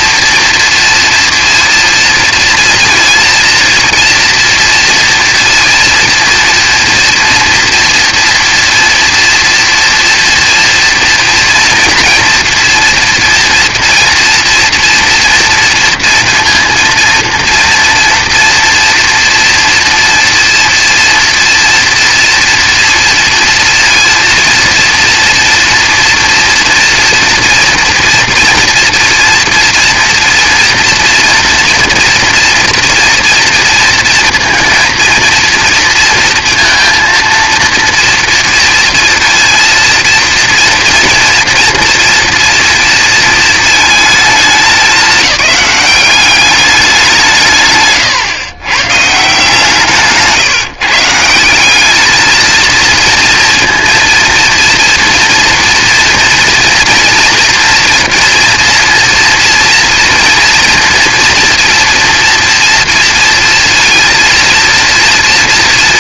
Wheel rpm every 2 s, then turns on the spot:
230, 230, 230, 240, 240, 240, 230, 230, 230, 230, 230, 230, 230, 240, 230, 240, 230, 230, 230, 230, 230, 230, 210, 190, 130, 140, 230, 230, 240, 230, 230, 230, 230.
none